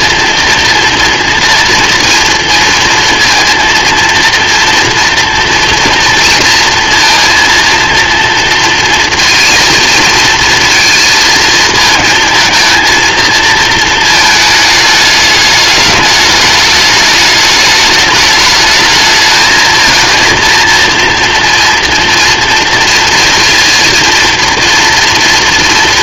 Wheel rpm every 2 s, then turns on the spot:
230, 230, 230, 230, 230, 230, 230, 220, 210, 210, 230, 230, 230.
none